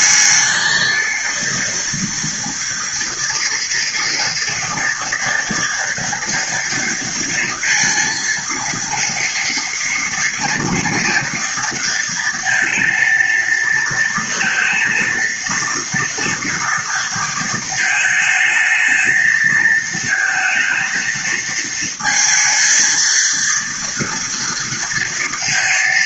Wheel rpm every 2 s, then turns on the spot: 220, 230, 230, 230, 230, 230, 230, 230, 230, 220, 230, 230, 230.
none